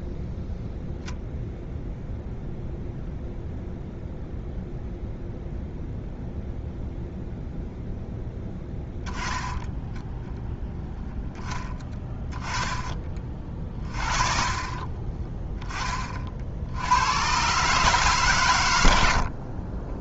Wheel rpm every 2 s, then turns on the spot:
10, 0, 0, 0, 10, 0, 10, 30, 90, 90.
12-14